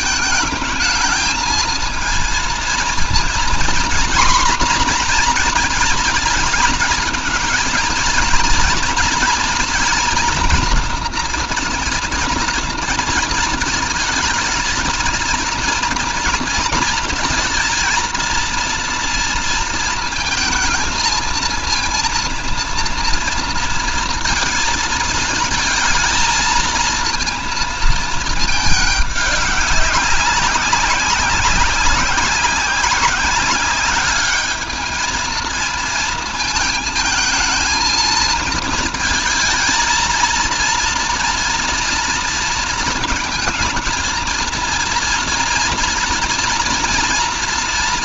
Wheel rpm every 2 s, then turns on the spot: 220, 230, 240, 220, 230, 240, 230, 230, 230, 230, 230, 230, 220, 230, 200, 190, 190, 220, 220, 220, 230, 220, 230, 230.
none